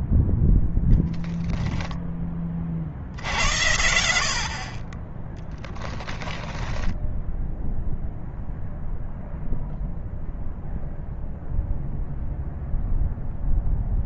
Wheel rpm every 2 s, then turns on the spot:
0, 50, 30, 10, 0, 0, 0.
6-8